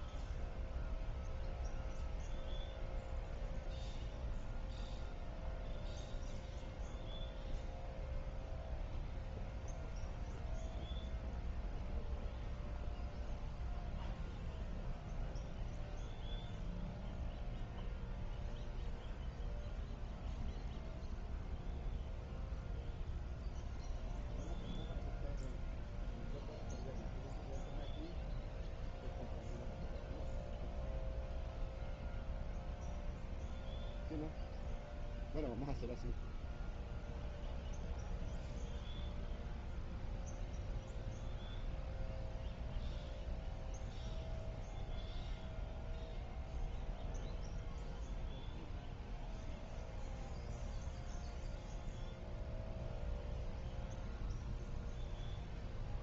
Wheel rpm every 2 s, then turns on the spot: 0, 0, 0, 0, 0, 0, 0, 0, 0, 0, 0, 0, 0, 0, 0, 0, 0, 0, 0, 0, 0, 0, 0, 0, 0, 0, 0, 0.
none